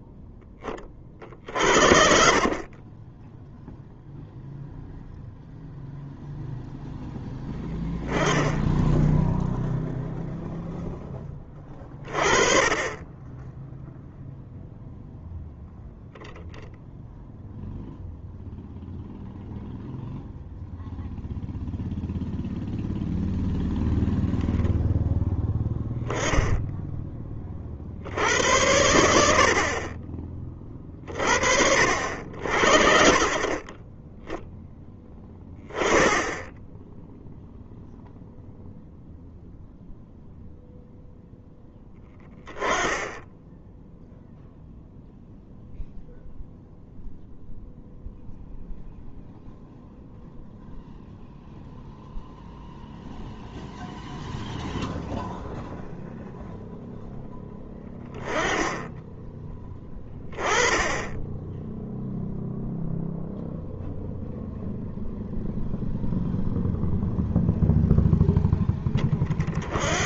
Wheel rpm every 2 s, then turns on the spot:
10, 40, 0, 0, 10, 0, 30, 0, 0, 0, 0, 0, 0, 10, 90, 30, 60, 10, 10, 0, 0, 10, 0, 0, 0, 0, 0, 0, 0, 20, 20, 0, 0, 0, 20.
none